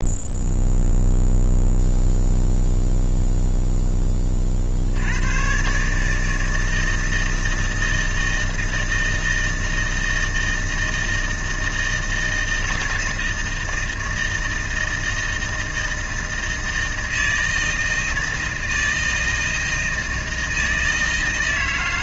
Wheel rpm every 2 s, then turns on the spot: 0, 0, 50, 160, 160, 160, 160, 160, 160, 160, 160.
none